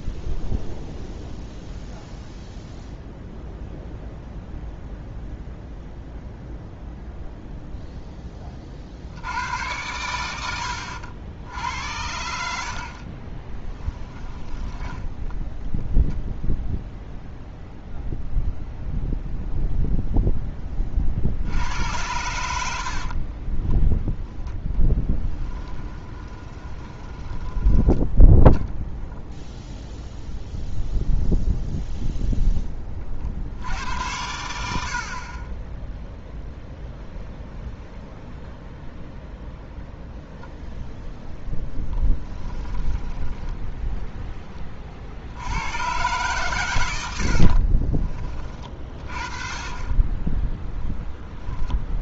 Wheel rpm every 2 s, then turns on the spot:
0, 0, 0, 0, 40, 90, 60, 10, 0, 0, 20, 80, 10, 20, 0, 0, 10, 80, 0, 0, 0, 10, 30, 110, 40, 0.
10-12 14-16 22-24 26-28 42-44